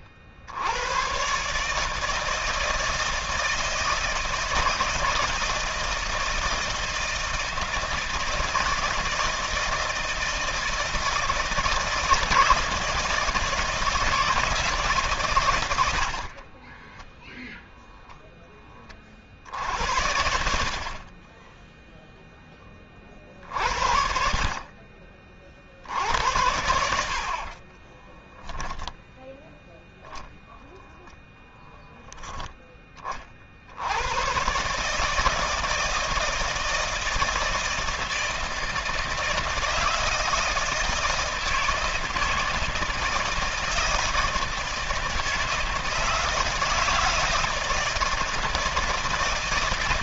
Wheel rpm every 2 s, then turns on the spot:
110, 160, 160, 160, 160, 160, 160, 150, 30, 40, 40, 30, 40, 80, 0, 0, 30, 150, 160, 160, 160, 160, 160, 160, 160.
16-18 26-28